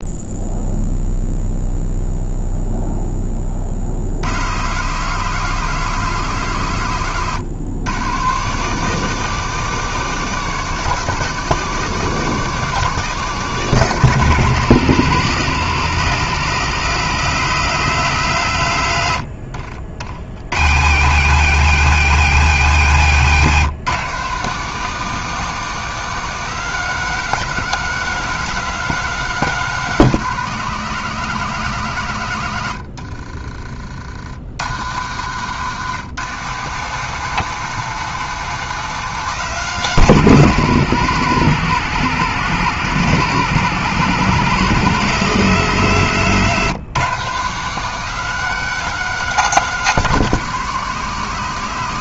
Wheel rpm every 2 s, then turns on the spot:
0, 0, 110, 130, 160, 180, 180, 150, 140, 120, 100, 150, 160, 180, 170, 160, 100, 90, 150, 170, 140, 110, 130, 140, 180, 150.
none